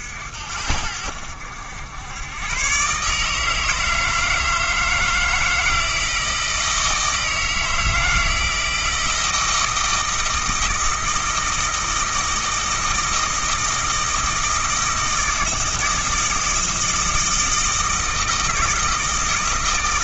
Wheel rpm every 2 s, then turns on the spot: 70, 130, 160, 160, 160, 160, 160, 160, 160, 160.
none